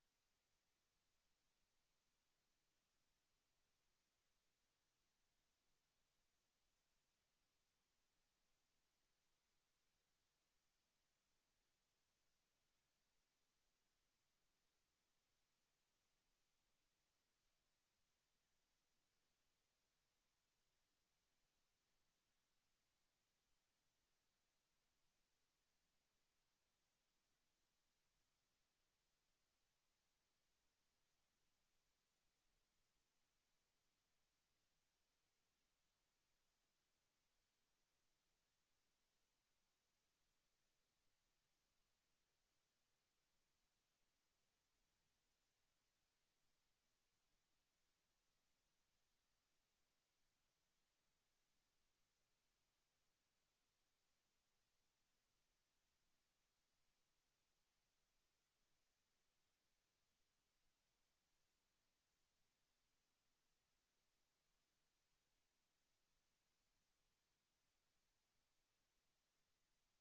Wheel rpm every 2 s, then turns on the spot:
0, 0, 0, 0, 0, 0, 0, 0, 0, 0, 0, 0, 0, 0, 0, 0, 0, 0, 0, 0, 0, 0, 0, 0, 0, 0, 0, 0, 0, 0, 0, 0, 0, 0, 0.
none